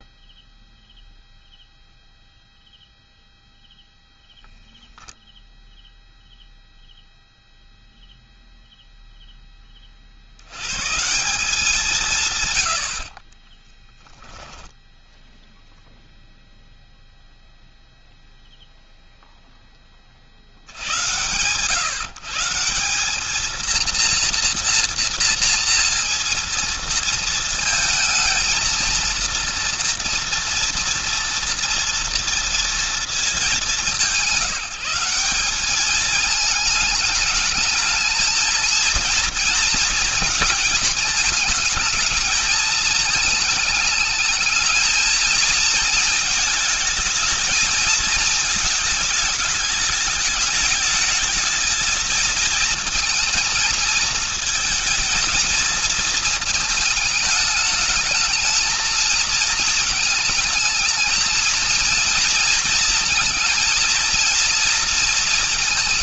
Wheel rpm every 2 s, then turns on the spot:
0, 0, 0, 0, 0, 90, 140, 0, 0, 0, 60, 160, 230, 230, 230, 230, 230, 190, 220, 230, 230, 210, 220, 220, 220, 210, 220, 220, 220, 220, 220, 230, 230.
none